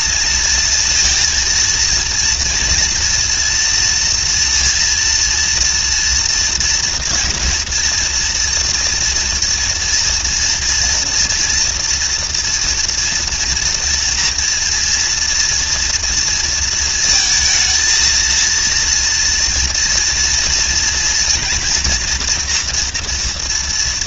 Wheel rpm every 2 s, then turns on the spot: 230, 230, 230, 240, 230, 230, 230, 230, 220, 230, 230, 230.
none